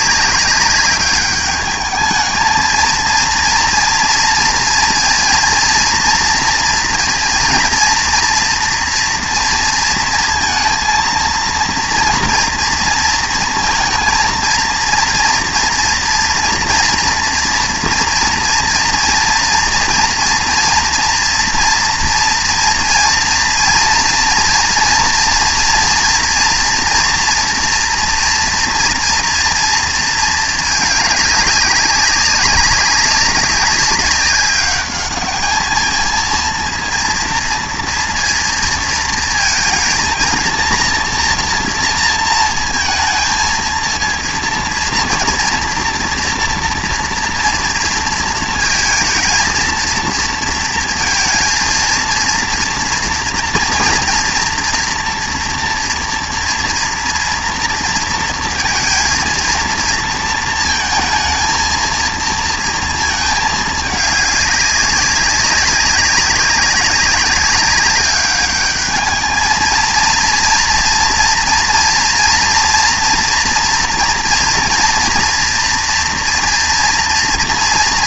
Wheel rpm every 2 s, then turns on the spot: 200, 230, 230, 230, 240, 230, 230, 230, 230, 240, 230, 230, 230, 230, 230, 210, 200, 200, 230, 230, 240, 220, 230, 230, 230, 230, 230, 230, 230, 230, 220, 230, 200, 200, 210, 230, 240, 230, 230.
none